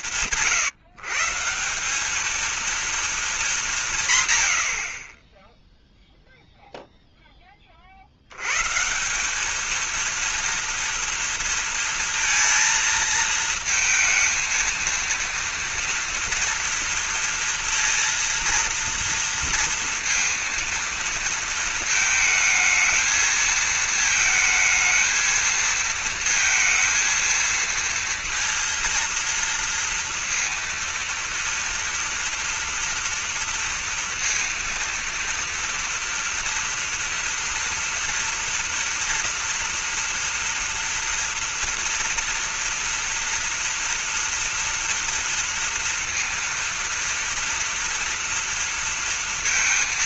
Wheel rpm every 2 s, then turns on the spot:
80, 220, 30, 20, 200, 230, 220, 230, 230, 230, 230, 220, 220, 230, 230, 230, 230, 240, 230, 240, 240, 230, 230, 230, 230.
none